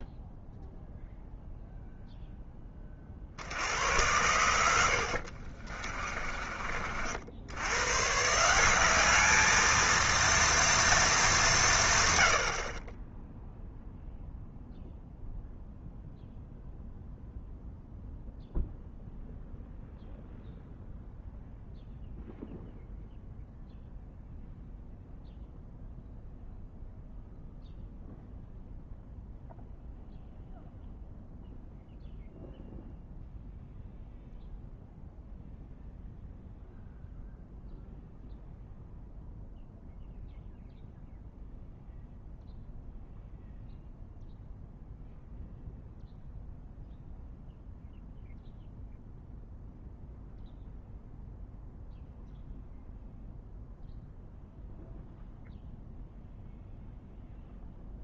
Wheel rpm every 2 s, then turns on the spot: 0, 20, 90, 40, 180, 230, 60, 0, 0, 0, 0, 0, 0, 0, 0, 0, 0, 0, 0, 0, 0, 0, 0, 0, 0, 0, 0, 0, 0.
4-6